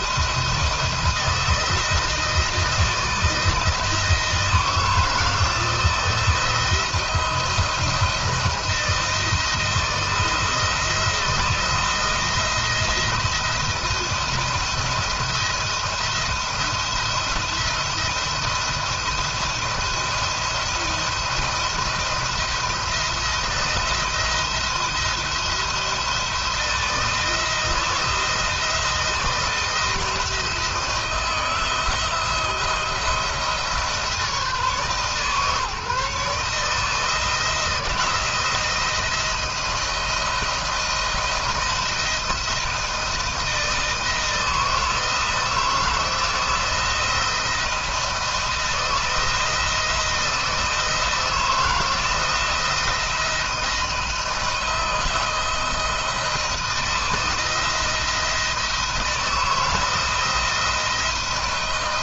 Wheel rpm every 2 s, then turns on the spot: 170, 160, 160, 170, 160, 160, 160, 160, 170, 170, 170, 170, 170, 160, 170, 170, 170, 150, 160, 160, 170, 170, 160, 160, 160, 160, 170, 160, 160, 170, 170.
none